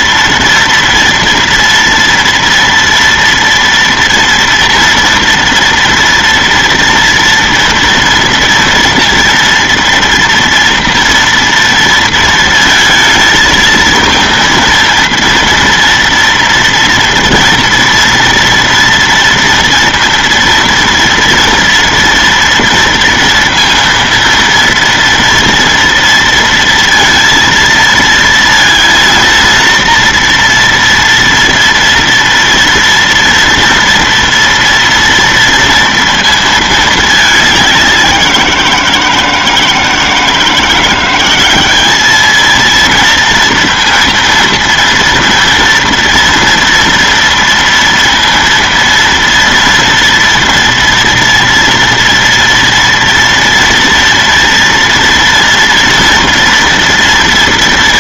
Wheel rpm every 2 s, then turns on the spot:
230, 230, 230, 230, 230, 230, 230, 230, 230, 230, 240, 230, 230, 230, 230, 230, 230, 230, 230, 180, 160, 220, 230, 230, 230, 230, 230, 230, 230.
none